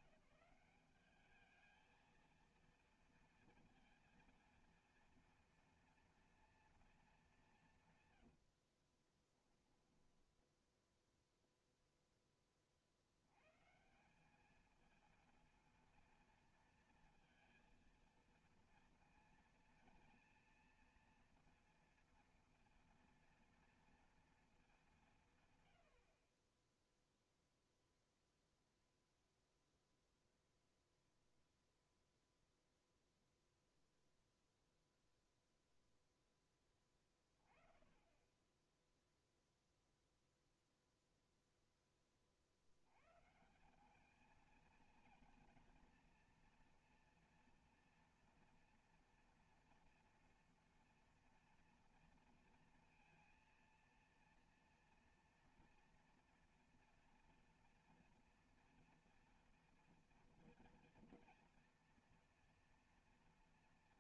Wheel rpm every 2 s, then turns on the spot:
200, 230, 230, 230, 50, 10, 40, 220, 230, 230, 230, 230, 210, 10, 0, 0, 0, 0, 20, 10, 0, 90, 220, 230, 240, 240, 230, 230, 230, 240, 230, 230.
8-10